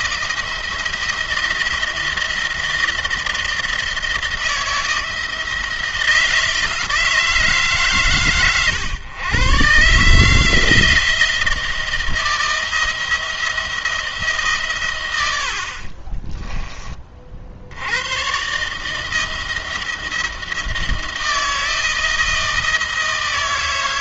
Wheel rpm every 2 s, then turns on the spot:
170, 170, 160, 160, 120, 160, 170, 130, 20, 140, 170, 160.
none